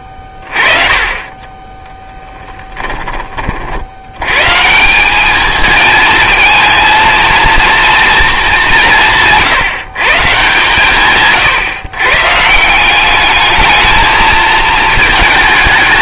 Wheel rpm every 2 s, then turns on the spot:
20, 10, 160, 220, 200, 140, 180, 220.
2-4